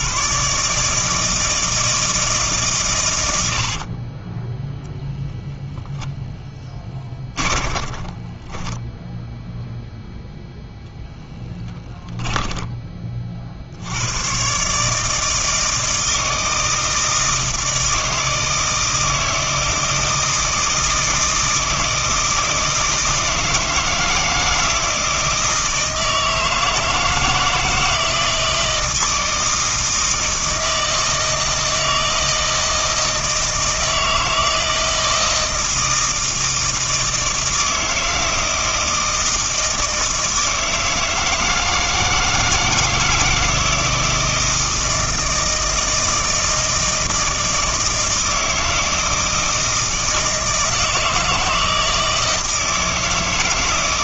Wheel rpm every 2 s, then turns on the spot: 150, 140, 0, 20, 10, 0, 20, 150, 160, 160, 160, 160, 160, 160, 160, 160, 160, 160, 160, 160, 160, 160, 160, 160, 160, 160, 160.
6-10